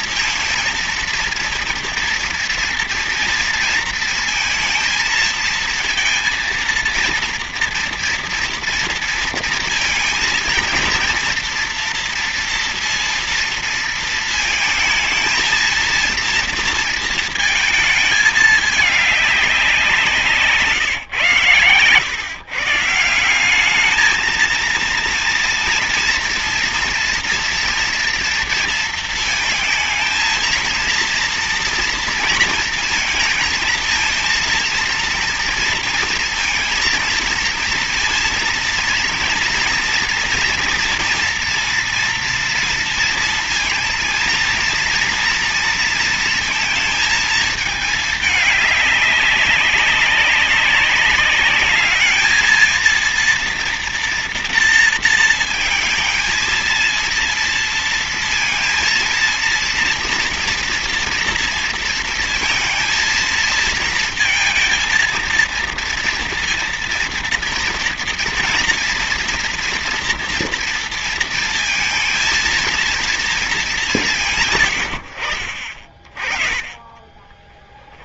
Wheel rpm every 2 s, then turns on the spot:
230, 230, 230, 230, 230, 230, 230, 220, 230, 210, 170, 130, 230, 230, 230, 230, 230, 230, 230, 230, 230, 230, 230, 230, 210, 190, 220, 230, 230, 230, 230, 230, 230, 230, 240, 230, 230, 150, 40.
none